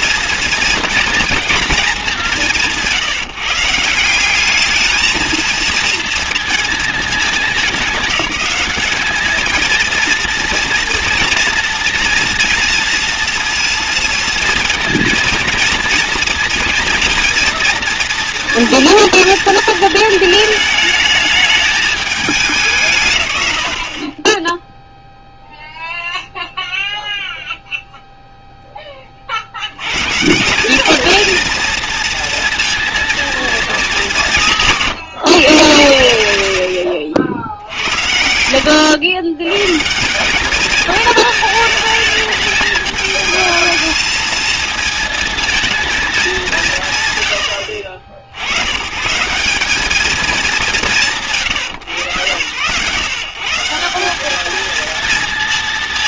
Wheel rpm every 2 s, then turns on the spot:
230, 170, 210, 220, 190, 230, 230, 230, 230, 230, 220, 180, 10, 0, 10, 190, 230, 160, 80, 90, 210, 220, 220, 190, 100, 190, 110, 220.
none